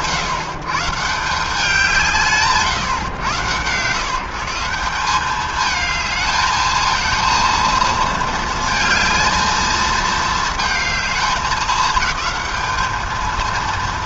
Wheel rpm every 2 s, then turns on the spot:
130, 140, 170, 220, 230, 220, 220.
none